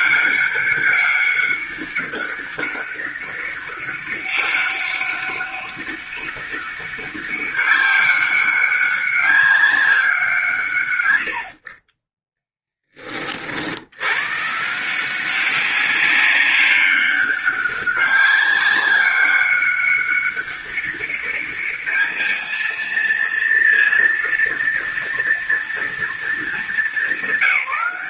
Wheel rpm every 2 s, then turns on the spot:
200, 200, 200, 200, 200, 130, 10, 150, 200, 200, 200, 220, 230, 200.
none